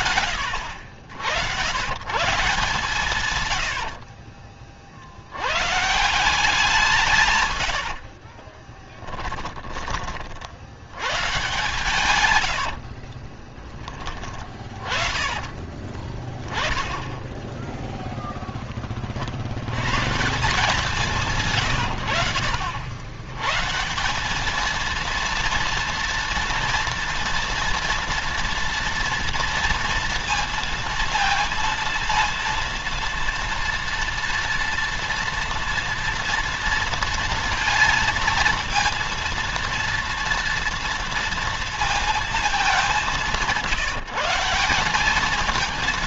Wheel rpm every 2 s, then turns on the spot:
70, 150, 60, 160, 10, 100, 50, 40, 10, 20, 180, 80, 220, 230, 230, 230, 230, 230, 230, 230, 230, 190, 190.
8-10 12-16